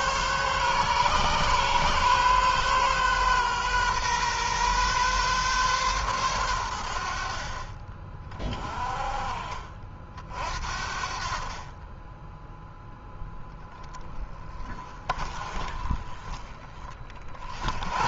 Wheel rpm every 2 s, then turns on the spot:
130, 130, 130, 80, 30, 60, 10, 30, 40.
none